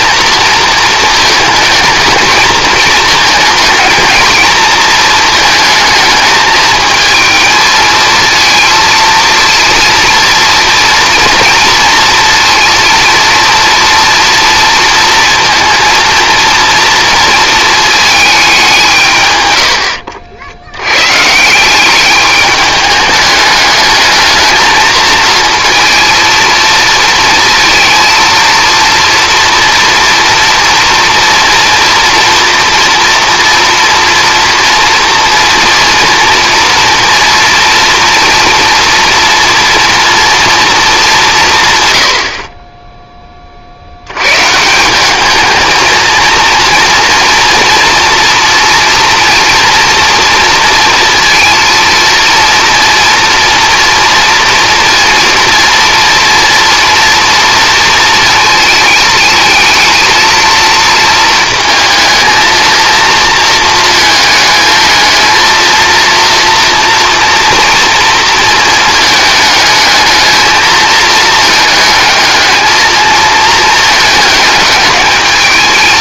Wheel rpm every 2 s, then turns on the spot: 220, 220, 220, 220, 230, 230, 230, 230, 230, 190, 90, 210, 220, 230, 230, 230, 240, 230, 240, 230, 220, 30, 160, 240, 230, 230, 230, 230, 230, 230, 230, 230, 220, 230, 220, 220, 220, 210.
none